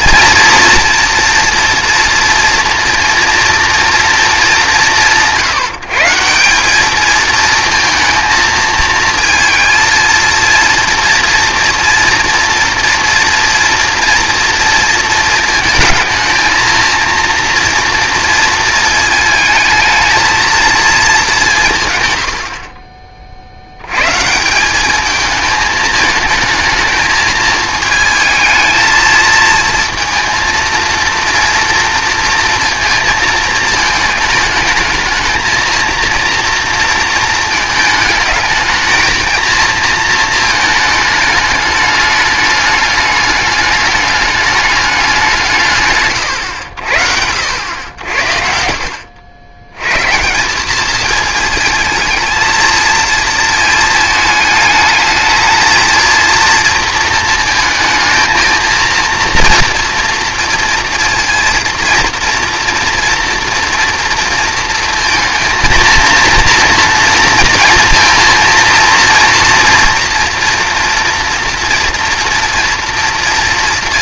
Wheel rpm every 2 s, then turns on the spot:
230, 230, 190, 210, 220, 230, 240, 230, 230, 230, 230, 50, 190, 220, 220, 230, 230, 220, 230, 220, 220, 210, 200, 80, 60, 200, 230, 220, 230, 230, 230, 230, 230, 230, 230, 230, 230.
48-50